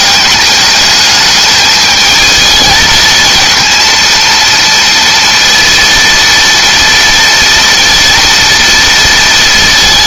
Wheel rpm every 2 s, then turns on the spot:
210, 230, 230, 230, 230.
none